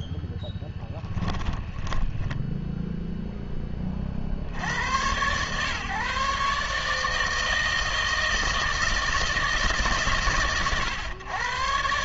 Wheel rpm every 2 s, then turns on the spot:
10, 0, 50, 150, 160, 120.
0-2